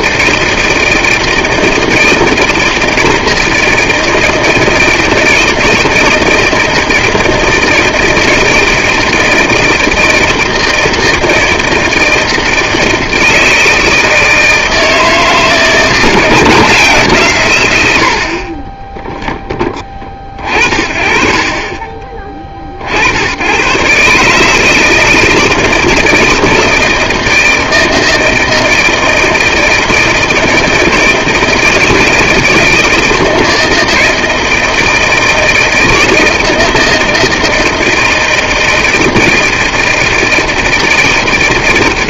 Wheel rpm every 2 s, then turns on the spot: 160, 160, 160, 160, 160, 160, 160, 160, 160, 20, 40, 50, 150, 160, 160, 160, 160, 160, 160, 160, 160.
none